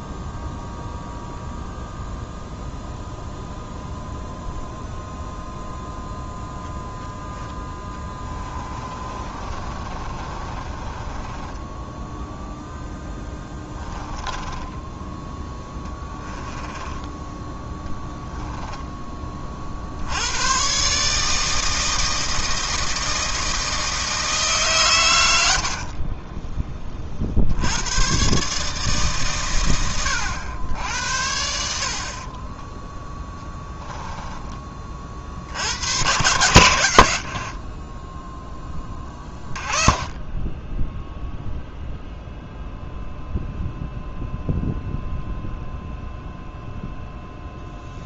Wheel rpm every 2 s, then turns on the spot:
0, 0, 0, 0, 30, 20, 0, 10, 10, 20, 140, 160, 120, 40, 140, 80, 10, 30, 100, 20, 0, 0, 0, 0.
8-12 14-18 36-38